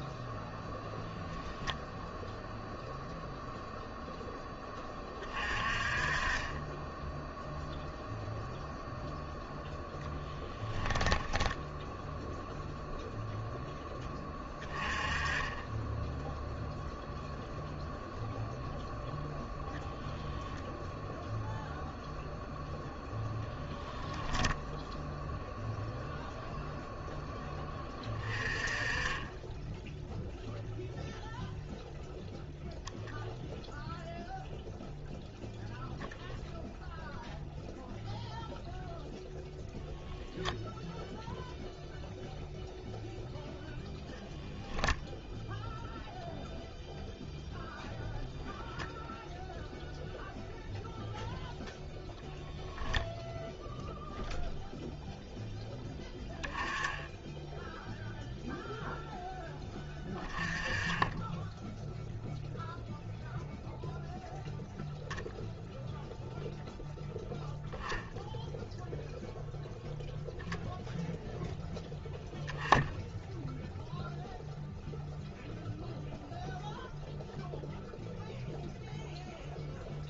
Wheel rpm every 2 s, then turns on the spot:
10, 0, 20, 10, 0, 10, 0, 20, 0, 0, 0, 0, 0, 0, 20, 0, 0, 0, 0, 0, 0, 0, 0, 0, 0, 0, 0, 0, 10, 0, 20, 0, 0, 0, 0, 0, 0, 0, 0, 0.
10-12